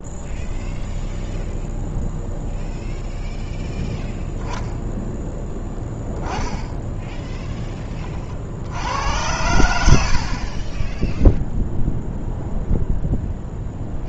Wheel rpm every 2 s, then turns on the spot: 0, 0, 0, 10, 90, 20, 0.
none